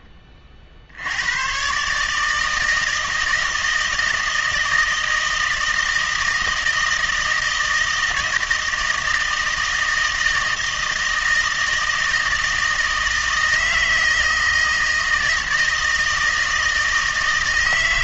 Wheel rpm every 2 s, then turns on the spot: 50, 160, 160, 160, 160, 160, 160, 160, 160.
none